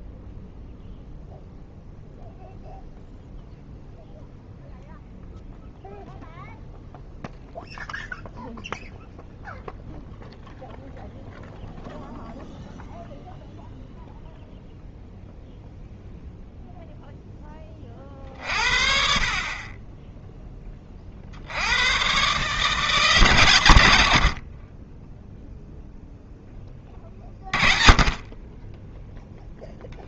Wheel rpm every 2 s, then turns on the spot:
0, 0, 0, 0, 0, 0, 0, 0, 0, 50, 30, 160, 30, 20, 10.
none